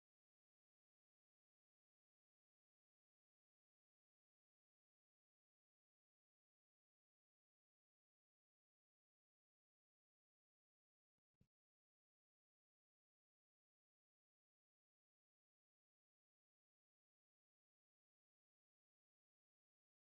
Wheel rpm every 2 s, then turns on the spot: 0, 0, 0, 0, 0, 0, 0, 0, 0, 0.
none